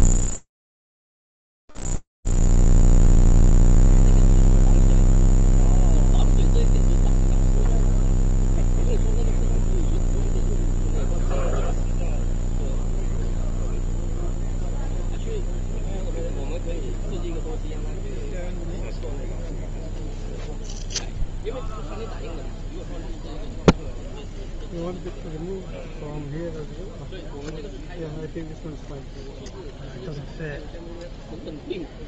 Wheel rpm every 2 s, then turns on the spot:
0, 0, 0, 0, 0, 0, 0, 0, 0, 0, 0, 0, 0, 0, 0, 0.
none